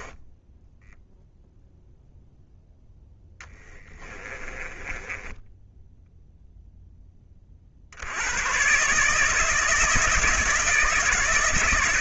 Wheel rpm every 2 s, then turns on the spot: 0, 10, 10, 20, 150, 160.
2-6